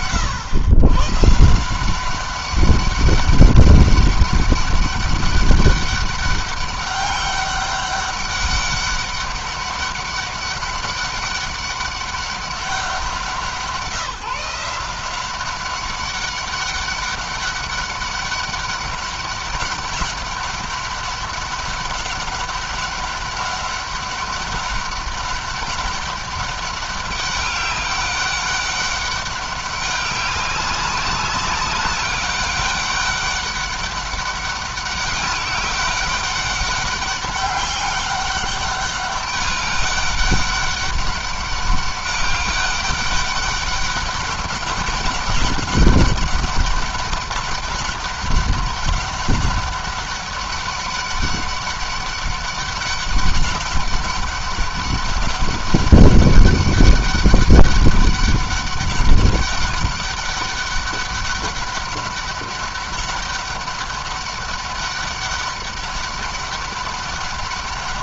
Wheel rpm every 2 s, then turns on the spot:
140, 200, 200, 200, 200, 200, 190, 170, 200, 200, 200, 200, 190, 200, 200, 200, 200, 190, 200, 200, 200, 200, 200, 200, 200, 200, 200, 200, 200, 200, 200, 200, 200, 200.
none